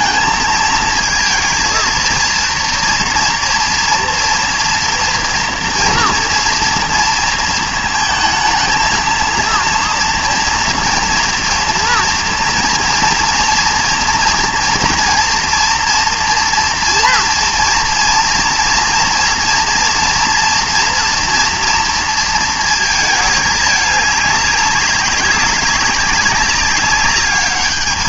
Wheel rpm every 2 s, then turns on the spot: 220, 230, 230, 230, 220, 230, 240, 230, 240, 230, 230, 220, 200, 200.
none